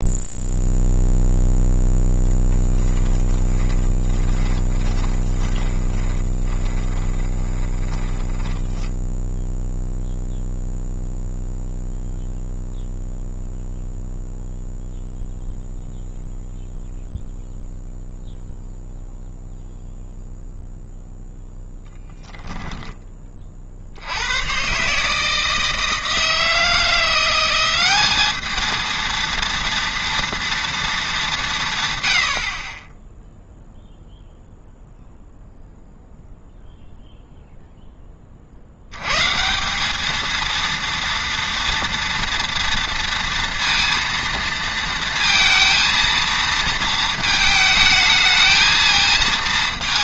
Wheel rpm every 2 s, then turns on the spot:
0, 10, 20, 20, 10, 0, 0, 0, 0, 0, 0, 0, 120, 160, 220, 240, 40, 0, 0, 60, 230, 230, 230, 230, 220.
4-10